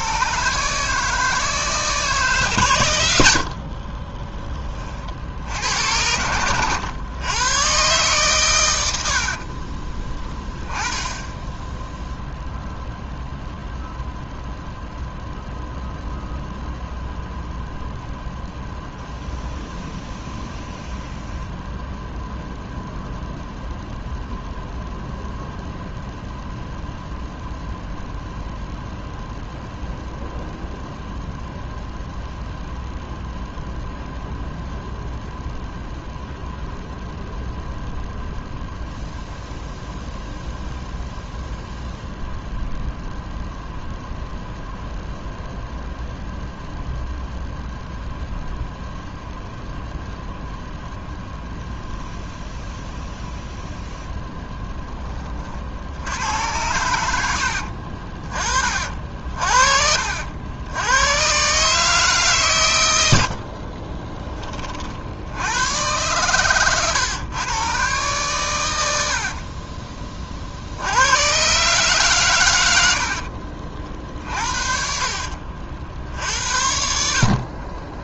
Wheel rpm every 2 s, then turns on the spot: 150, 130, 30, 110, 100, 10, 0, 0, 0, 0, 0, 0, 0, 0, 0, 0, 0, 0, 0, 0, 0, 0, 0, 0, 0, 0, 0, 0, 90, 40, 90, 120, 40, 120, 90, 70, 90, 50, 60.
74-76